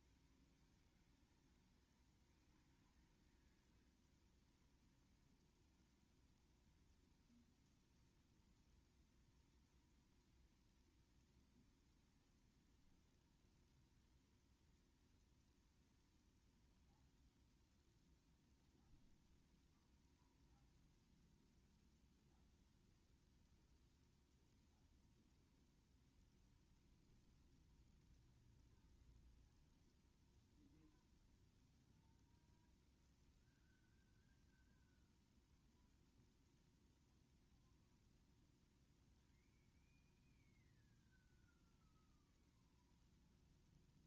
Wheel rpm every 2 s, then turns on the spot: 0, 0, 0, 0, 0, 0, 0, 0, 0, 0, 0, 0, 0, 0, 0, 0, 0, 0, 0, 0, 0, 0.
none